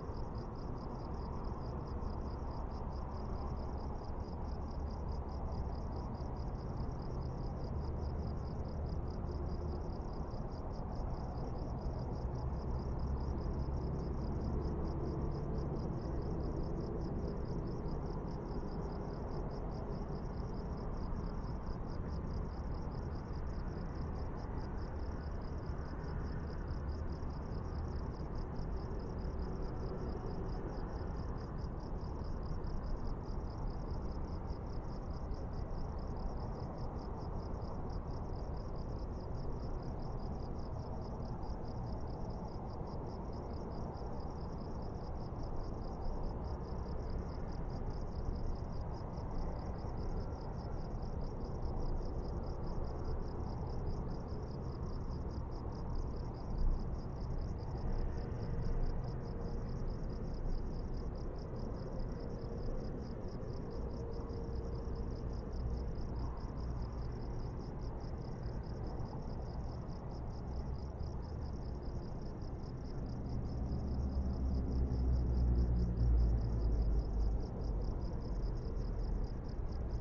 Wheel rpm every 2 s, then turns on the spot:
0, 0, 0, 0, 0, 0, 0, 0, 0, 0, 0, 0, 0, 0, 0, 0, 0, 0, 0, 0, 0, 0, 0, 0, 0, 0, 0, 0, 0, 0, 0, 0, 0, 0, 0, 0, 0, 0, 0, 0.
none